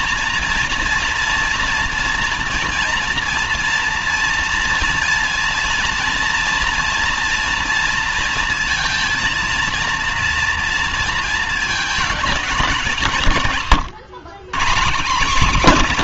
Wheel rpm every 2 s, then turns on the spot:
230, 230, 230, 230, 230, 230, 190, 160.
none